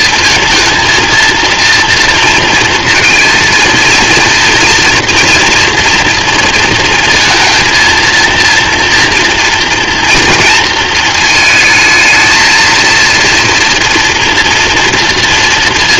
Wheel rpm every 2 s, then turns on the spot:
230, 230, 230, 230, 240, 230, 220, 240.
none